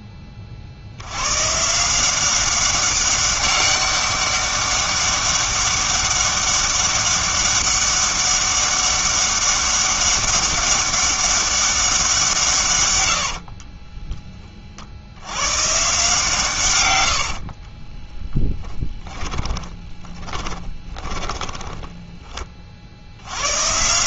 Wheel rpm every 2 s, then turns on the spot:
50, 190, 200, 200, 200, 200, 130, 40, 110, 10, 20, 40.
18-22